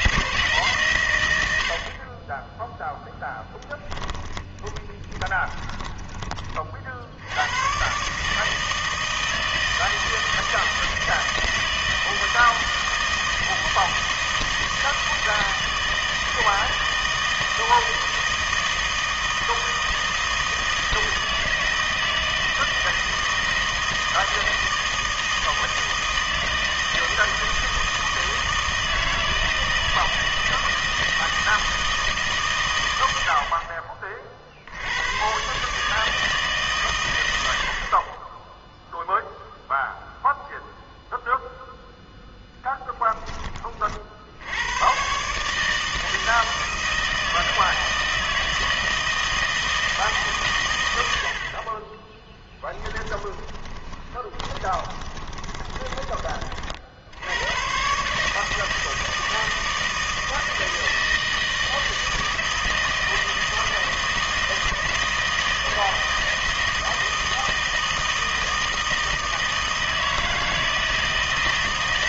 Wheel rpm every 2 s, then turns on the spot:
140, 10, 20, 40, 160, 160, 160, 160, 160, 160, 160, 160, 160, 160, 160, 160, 120, 70, 150, 10, 0, 10, 100, 160, 160, 120, 10, 20, 40, 160, 160, 160, 160, 160, 160, 160.
4-6 52-56